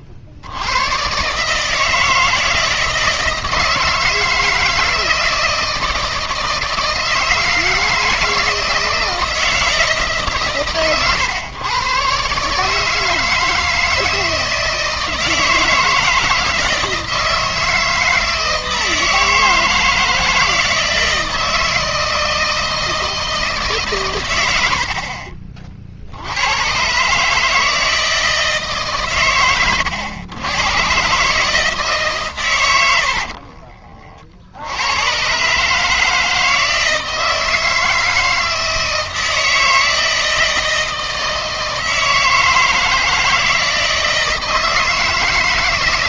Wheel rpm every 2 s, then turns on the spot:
90, 160, 160, 160, 160, 140, 150, 160, 160, 160, 160, 160, 80, 110, 150, 110, 110, 80, 160, 160, 160, 160, 160.
none